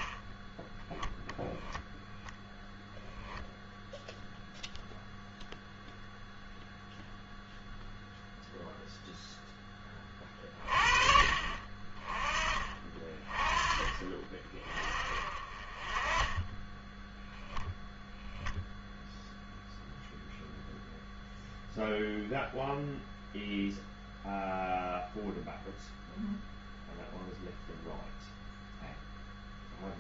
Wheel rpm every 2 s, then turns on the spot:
10, 10, 0, 0, 0, 30, 30, 40, 20, 0, 0, 0, 0, 0, 0.
none